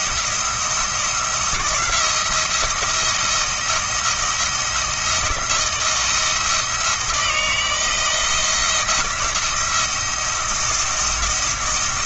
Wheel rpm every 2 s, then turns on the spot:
170, 170, 170, 160, 160, 170.
none